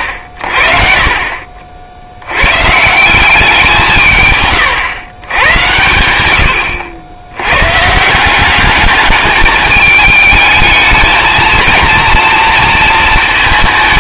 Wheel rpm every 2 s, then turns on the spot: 60, 120, 130, 80, 190, 220, 230.
none